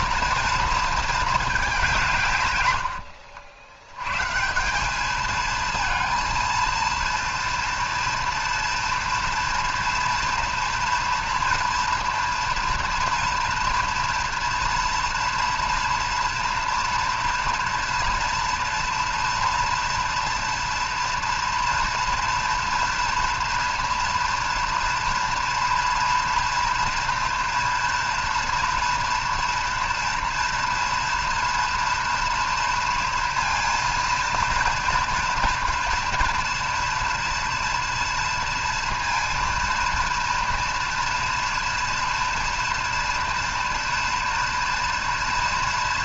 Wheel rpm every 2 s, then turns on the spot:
230, 100, 180, 230, 230, 240, 230, 230, 230, 230, 230, 230, 240, 230, 230, 230, 230, 230, 230, 230, 230, 230, 230.
none